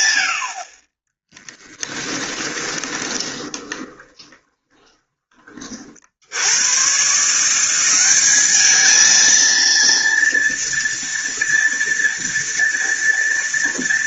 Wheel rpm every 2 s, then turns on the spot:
10, 20, 20, 140, 220, 230, 230.
2-4